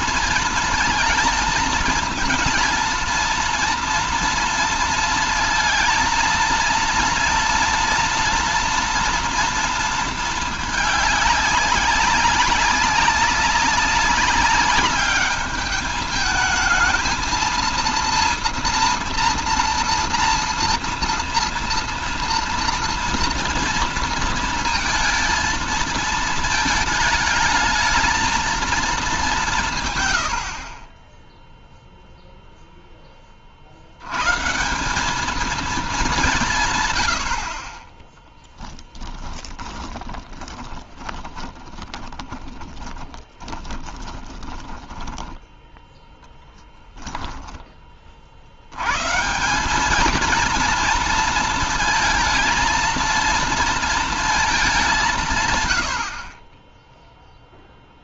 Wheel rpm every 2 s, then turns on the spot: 230, 220, 230, 230, 230, 220, 190, 200, 210, 230, 230, 230, 230, 220, 230, 60, 0, 160, 170, 10, 10, 20, 20, 0, 60, 220, 230, 210, 30.
38-46